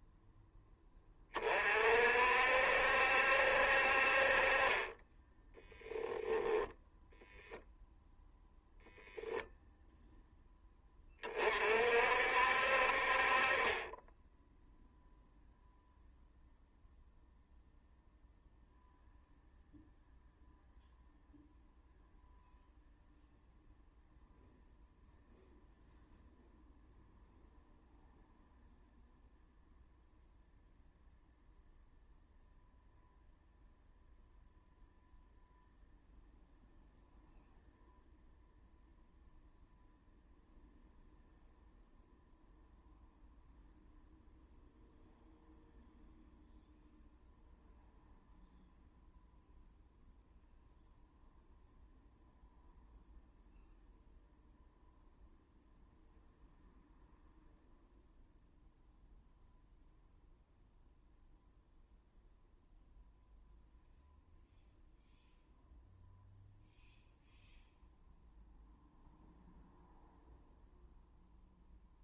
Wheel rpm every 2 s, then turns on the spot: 10, 70, 30, 0, 0, 10, 60, 0, 0, 0, 0, 0, 0, 0, 0, 0, 0, 0, 0, 0, 0, 0, 0, 0, 0, 0, 0, 0, 0, 0, 0, 0, 0, 0, 0, 0.
none